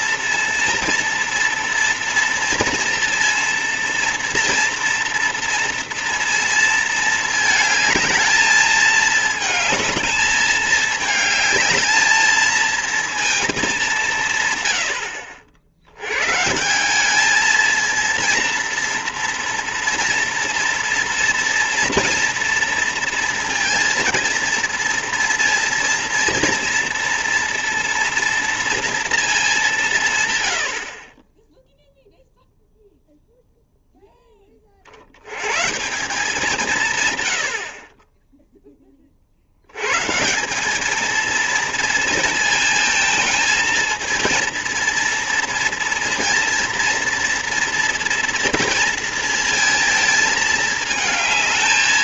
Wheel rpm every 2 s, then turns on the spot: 230, 230, 230, 220, 220, 220, 220, 90, 170, 230, 230, 230, 230, 230, 230, 60, 0, 50, 170, 10, 200, 230, 230, 230, 230, 220.
none